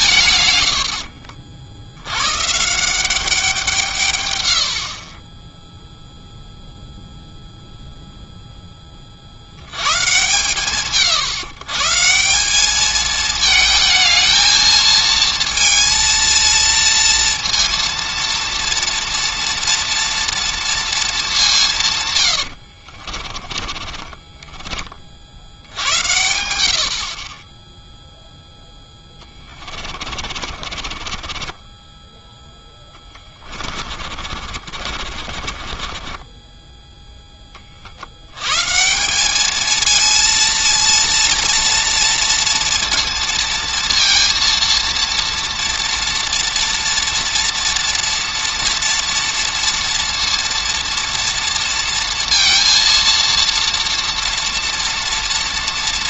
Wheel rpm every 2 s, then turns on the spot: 90, 170, 70, 0, 80, 150, 220, 230, 230, 230, 190, 30, 90, 10, 40, 10, 40, 20, 120, 230, 230, 230, 240, 230, 230, 230, 230, 230.
22-24 28-30 32-36